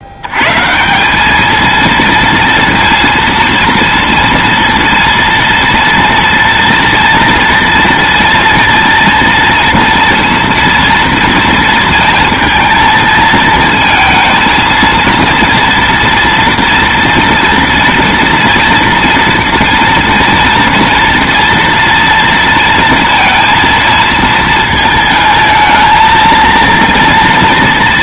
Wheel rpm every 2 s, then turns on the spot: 160, 230, 230, 230, 230, 230, 220, 230, 230, 230, 230, 230, 220, 230.
none